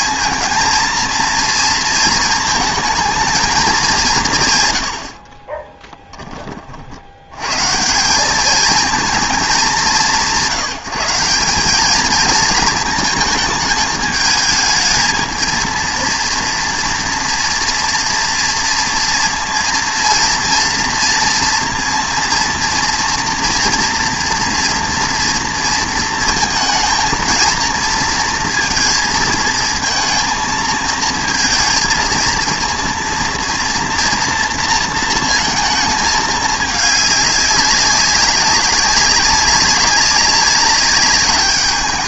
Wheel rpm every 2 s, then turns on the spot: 230, 220, 120, 40, 220, 170, 230, 220, 230, 230, 230, 240, 230, 230, 230, 220, 230, 230, 210, 200, 200.
none